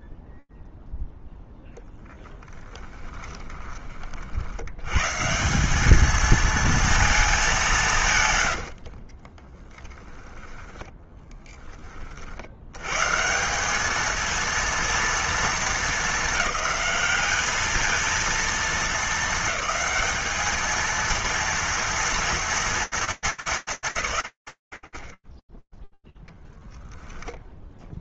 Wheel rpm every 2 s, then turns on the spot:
20, 0, 60, 220, 130, 10, 90, 230, 210, 220, 220, 230, 70, 0.
8-12